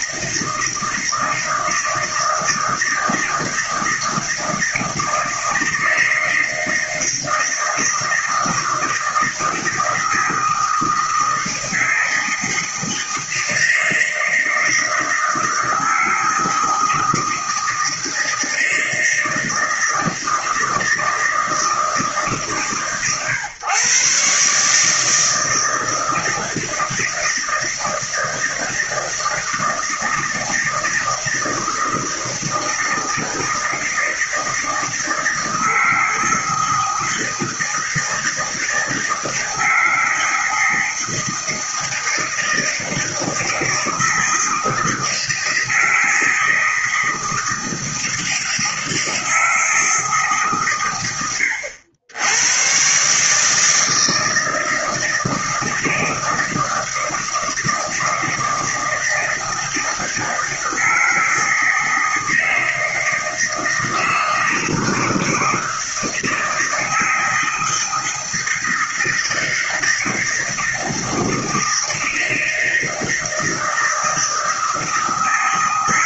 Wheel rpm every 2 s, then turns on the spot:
160, 160, 160, 160, 160, 160, 160, 160, 160, 160, 160, 120, 150, 160, 160, 160, 160, 160, 160, 160, 160, 160, 160, 160, 160, 120, 130, 160, 160, 160, 160, 160, 160, 160, 160, 160, 160, 160.
none